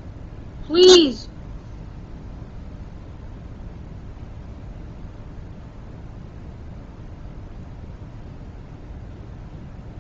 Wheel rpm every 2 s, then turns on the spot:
0, 0, 0, 0, 0.
none